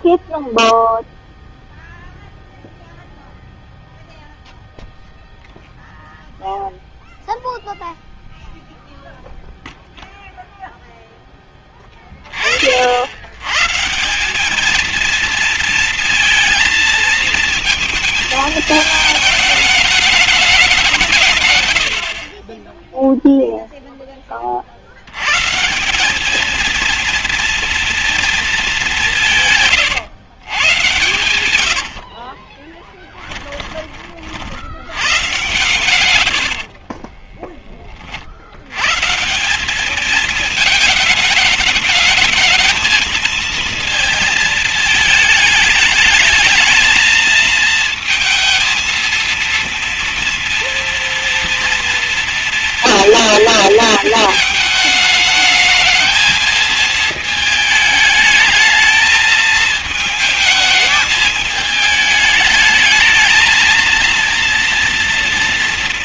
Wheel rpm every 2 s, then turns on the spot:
0, 0, 0, 0, 0, 0, 40, 210, 230, 220, 200, 20, 40, 220, 210, 120, 40, 30, 110, 60, 220, 220, 230, 220, 230, 230, 230, 220, 220, 220, 220, 220, 230.
32-34 36-38